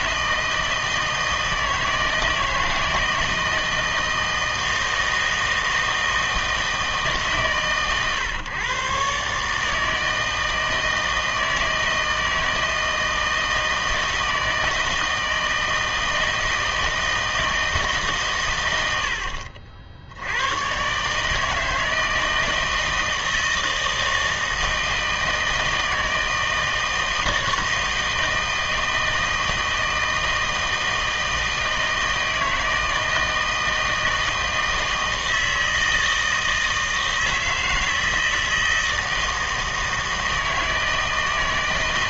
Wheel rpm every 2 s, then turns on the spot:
160, 160, 160, 160, 120, 160, 160, 160, 160, 100, 120, 160, 160, 160, 160, 160, 160, 160, 160, 160, 160.
none